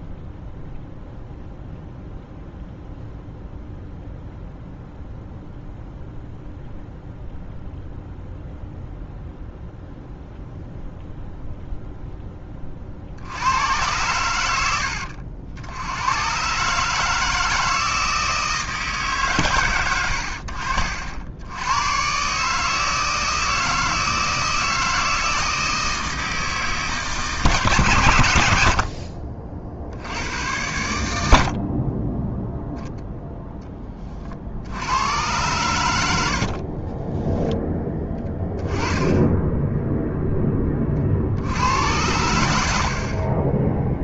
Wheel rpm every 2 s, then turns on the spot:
0, 0, 0, 0, 0, 0, 30, 80, 140, 160, 70, 150, 160, 160, 80, 100, 0, 70, 50, 10, 10, 80.
36-38